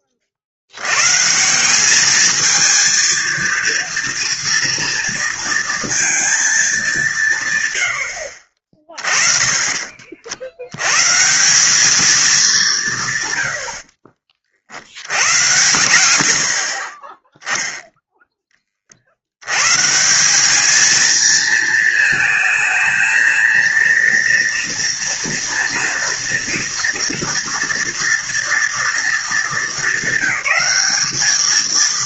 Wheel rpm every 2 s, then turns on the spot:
100, 220, 230, 210, 40, 120, 170, 80, 30, 40, 220, 220, 230, 230, 230, 210.
none